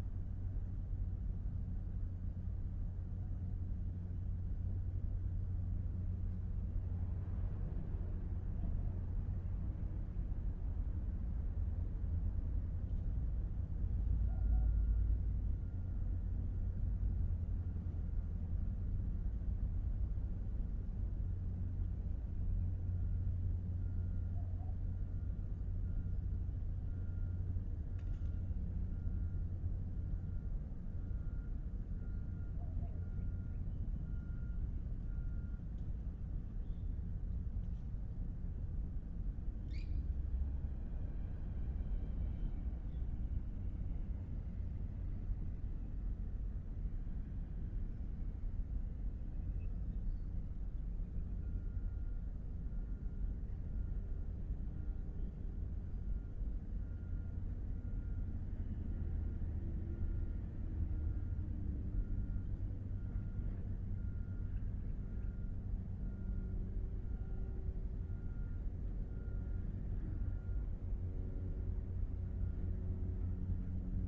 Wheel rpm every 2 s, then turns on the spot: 0, 0, 0, 0, 0, 0, 0, 0, 0, 0, 0, 0, 0, 0, 0, 0, 0, 0, 0, 0, 0, 0, 0, 0, 0, 0, 0, 0, 0, 0, 0, 0, 0, 0, 0, 0, 0.
none